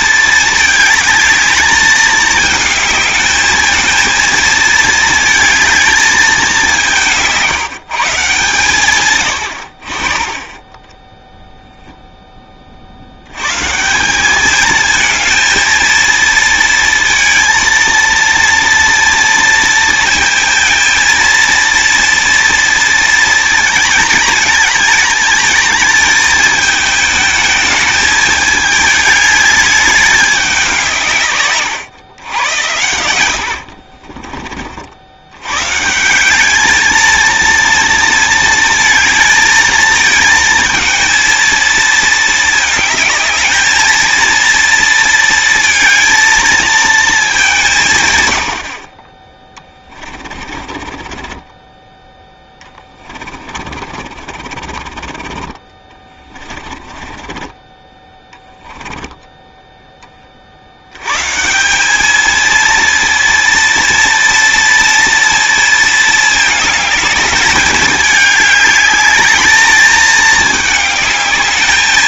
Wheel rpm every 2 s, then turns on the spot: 220, 220, 220, 180, 130, 10, 50, 220, 230, 230, 230, 230, 220, 220, 220, 180, 90, 60, 220, 220, 220, 220, 230, 230, 50, 40, 20, 40, 30, 10, 80, 230, 230, 220, 200, 210.
50-60